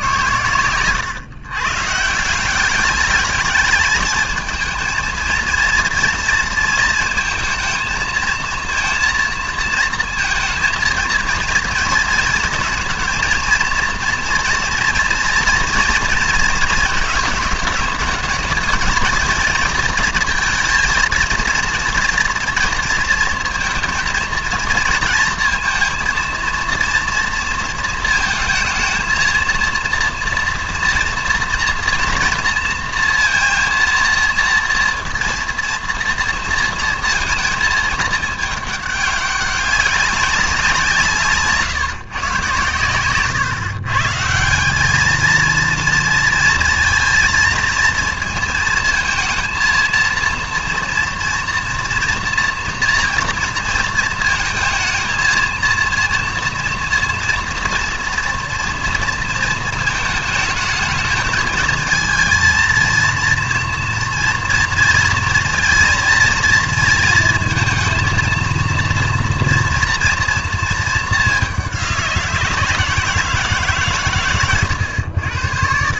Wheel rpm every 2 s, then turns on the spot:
120, 190, 220, 230, 230, 220, 230, 230, 220, 210, 230, 230, 230, 230, 220, 230, 230, 230, 230, 210, 180, 120, 170, 230, 220, 230, 230, 220, 230, 230, 220, 230, 230, 220, 230, 220, 170, 110.
none